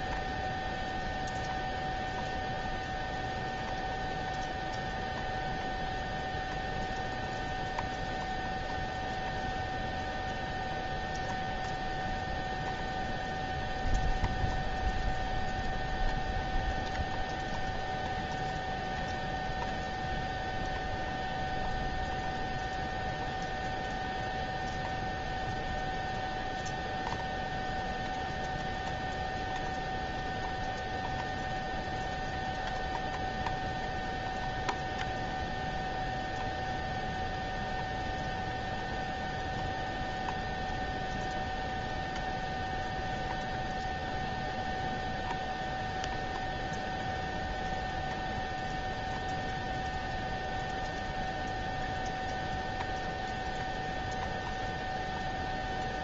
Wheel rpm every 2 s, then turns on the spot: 0, 0, 0, 0, 0, 0, 0, 0, 0, 0, 0, 0, 0, 0, 0, 0, 0, 0, 0, 0, 0, 0, 0, 0, 0, 0, 0, 0.
none